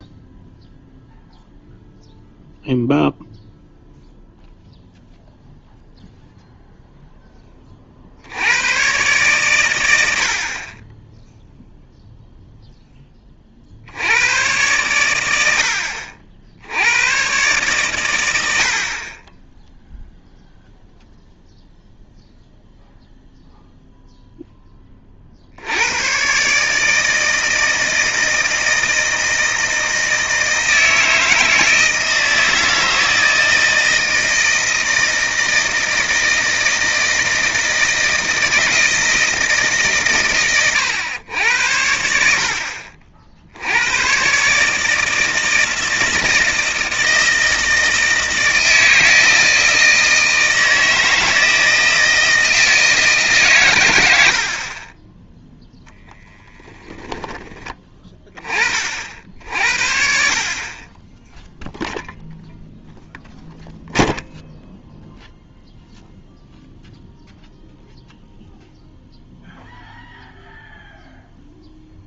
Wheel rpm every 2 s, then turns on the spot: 0, 0, 0, 0, 110, 40, 0, 110, 80, 70, 0, 0, 10, 140, 160, 160, 160, 160, 160, 160, 110, 60, 150, 160, 160, 160, 160, 40, 10, 40, 30, 0, 0, 0, 0, 0.
54-56